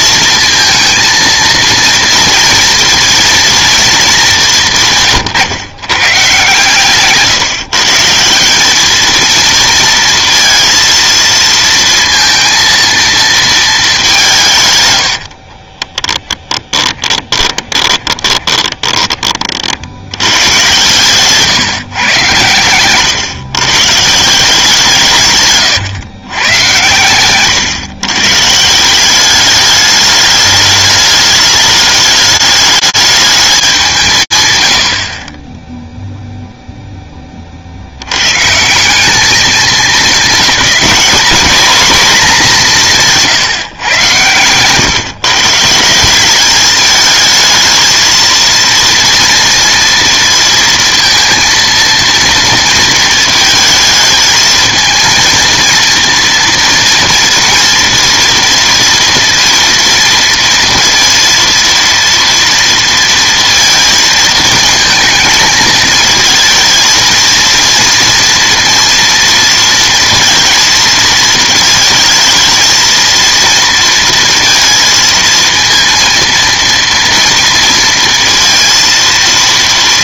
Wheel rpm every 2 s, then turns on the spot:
230, 230, 180, 140, 210, 230, 230, 140, 30, 20, 120, 120, 190, 120, 160, 210, 210, 90, 0, 190, 210, 180, 130, 210, 230, 230, 230, 230, 230, 230, 230, 230, 220, 220, 230, 230, 220, 230, 230, 230.
16-20